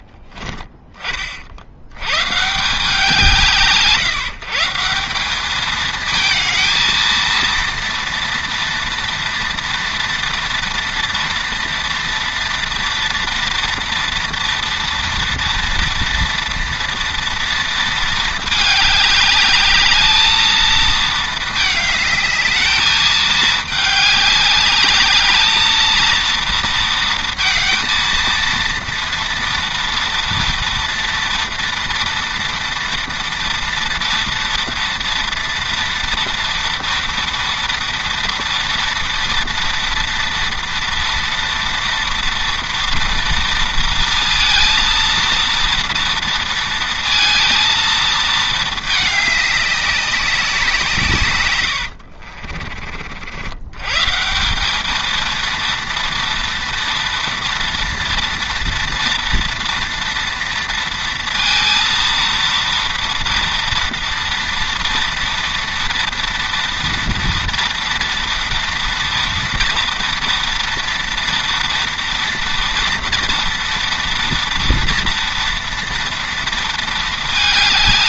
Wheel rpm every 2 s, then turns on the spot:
20, 170, 170, 220, 230, 230, 230, 230, 230, 210, 220, 210, 210, 220, 230, 230, 230, 230, 230, 230, 230, 230, 230, 230, 220, 170, 50, 210, 230, 230, 230, 230, 230, 230, 230, 240, 230, 230, 220.
none